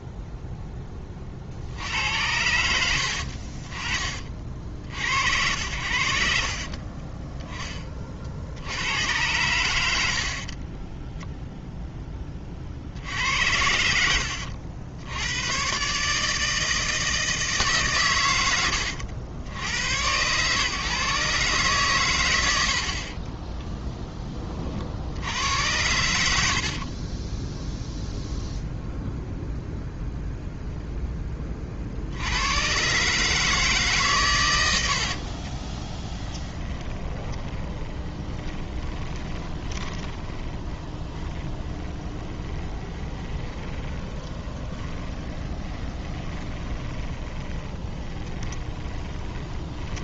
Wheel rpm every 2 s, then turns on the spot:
10, 80, 50, 50, 80, 30, 40, 70, 160, 90, 130, 70, 30, 50, 0, 0, 110, 100, 20, 20, 20, 20, 20, 20, 20.
6-8 10-12 26-28 34-50